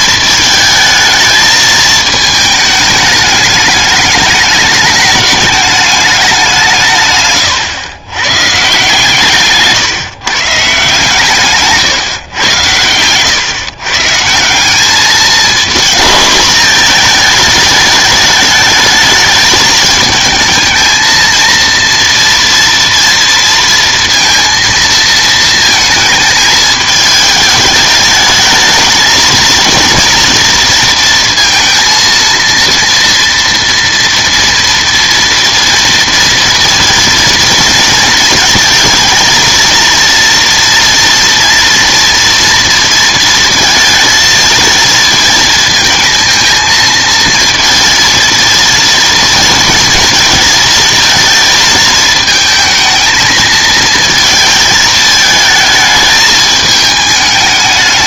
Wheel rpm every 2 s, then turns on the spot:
220, 220, 210, 170, 130, 140, 110, 190, 220, 210, 220, 230, 230, 220, 220, 240, 230, 230, 230, 220, 230, 230, 220, 220, 230, 230, 220, 220, 220.
none